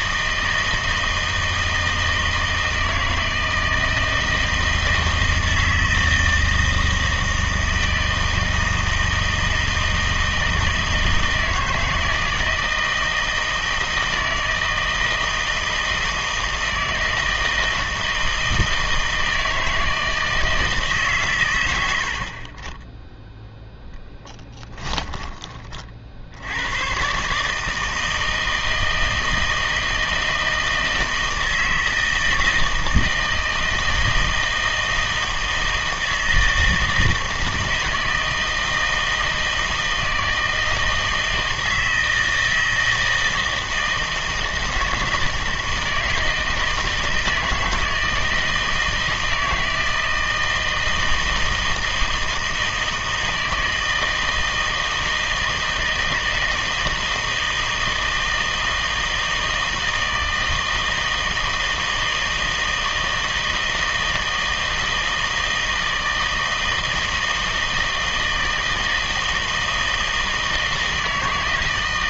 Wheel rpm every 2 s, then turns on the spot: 160, 160, 160, 160, 160, 160, 160, 160, 160, 160, 160, 20, 10, 100, 160, 160, 160, 160, 160, 160, 160, 160, 160, 160, 160, 160, 160, 160, 160, 160, 160, 160, 160, 160, 160, 160.
24-26